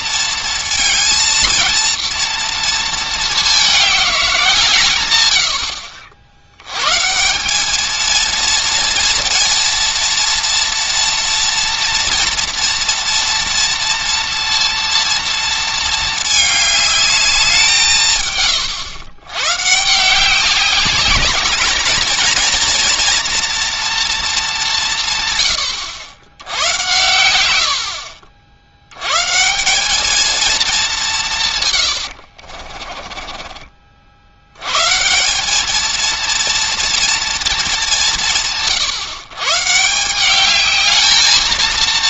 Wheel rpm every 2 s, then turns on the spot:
230, 220, 160, 120, 230, 230, 230, 230, 210, 120, 200, 230, 170, 90, 80, 210, 40, 130, 230, 120, 210.
32-34